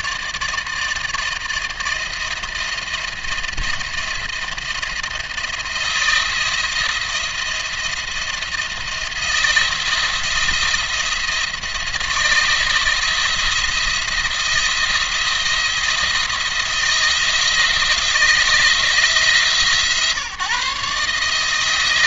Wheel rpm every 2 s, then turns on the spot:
160, 170, 170, 170, 170, 170, 170, 170, 170, 160, 140.
none